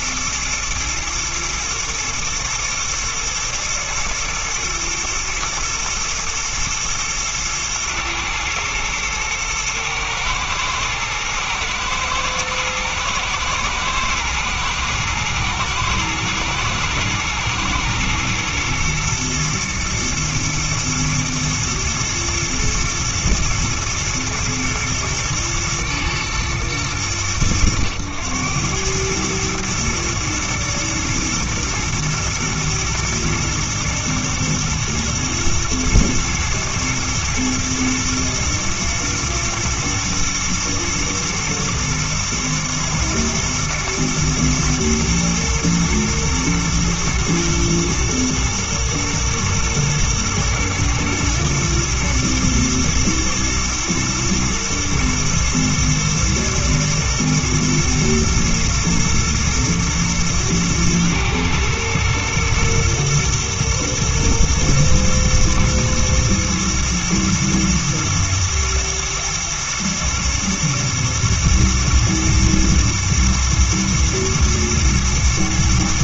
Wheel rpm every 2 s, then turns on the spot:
110, 120, 110, 120, 110, 110, 110, 110, 120, 120, 120, 110, 110, 110, 100, 120, 120, 120, 110, 120, 110, 120, 120, 110, 120, 110, 120, 110, 110, 110, 110, 120, 120, 120, 120, 120, 120, 110.
none